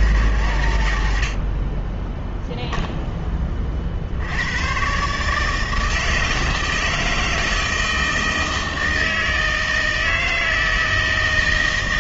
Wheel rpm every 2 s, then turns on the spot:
110, 0, 110, 160, 160, 160.
none